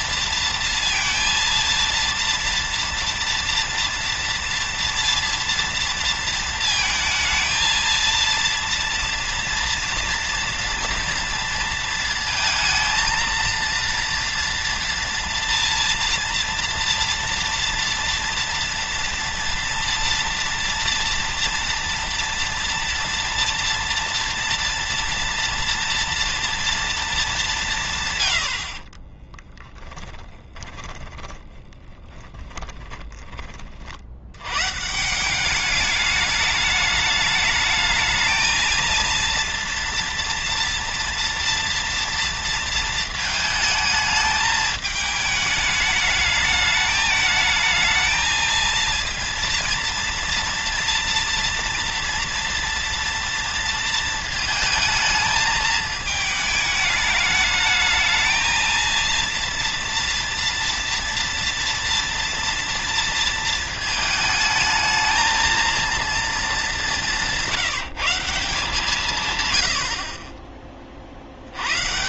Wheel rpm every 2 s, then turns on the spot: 230, 230, 230, 230, 230, 230, 220, 230, 240, 230, 230, 230, 230, 230, 40, 10, 20, 140, 210, 230, 230, 230, 210, 210, 230, 230, 230, 220, 210, 230, 230, 230, 220, 210, 170, 50.
28-34